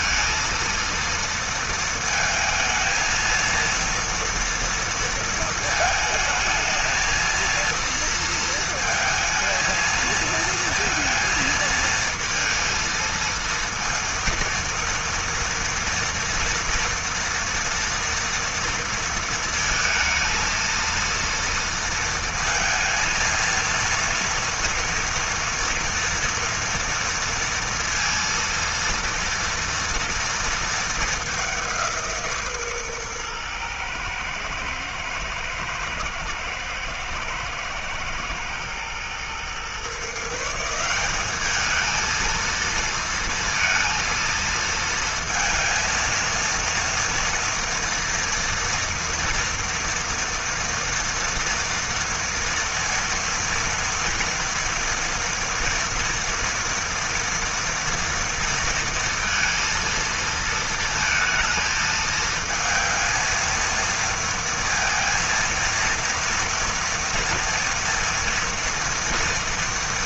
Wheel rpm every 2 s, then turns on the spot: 230, 230, 230, 220, 230, 230, 230, 230, 230, 230, 230, 230, 230, 230, 230, 210, 130, 120, 110, 120, 190, 230, 230, 230, 240, 230, 230, 230, 230, 230, 220, 230, 230, 230, 230.
none